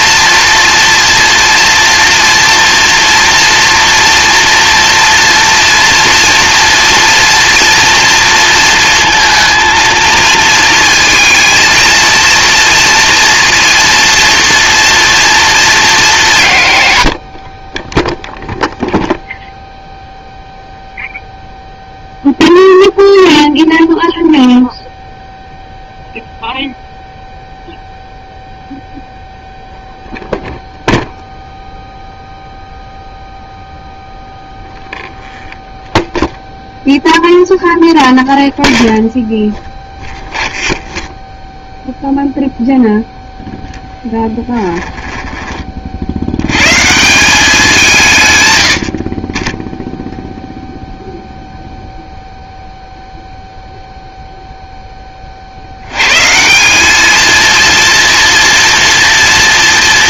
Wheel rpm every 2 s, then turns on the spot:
230, 230, 230, 230, 230, 230, 230, 240, 130, 0, 0, 0, 0, 0, 0, 0, 0, 0, 0, 0, 0, 0, 10, 120, 100, 0, 0, 0, 190, 230.
44-46